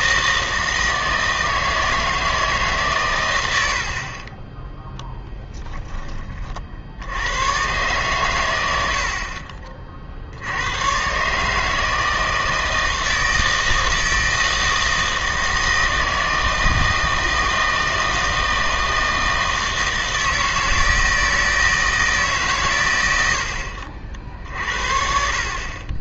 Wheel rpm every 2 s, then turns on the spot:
160, 150, 10, 60, 70, 90, 160, 160, 160, 160, 160, 110, 50.
none